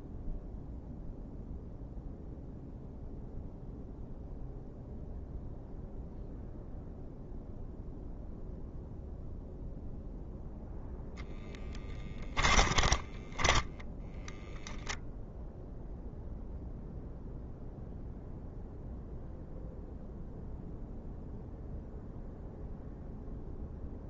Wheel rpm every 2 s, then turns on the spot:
0, 0, 0, 0, 0, 0, 20, 0, 0, 0, 0, 0.
12-14